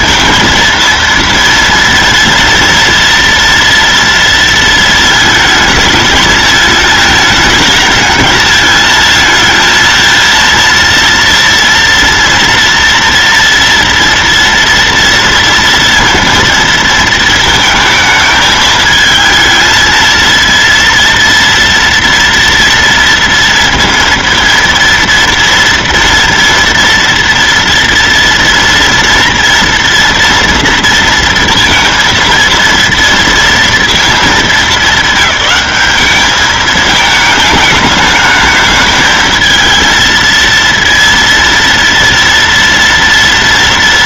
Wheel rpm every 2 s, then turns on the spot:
230, 230, 230, 220, 220, 230, 230, 230, 230, 220, 230, 230, 230, 230, 230, 230, 230, 210, 210, 210, 230, 230.
none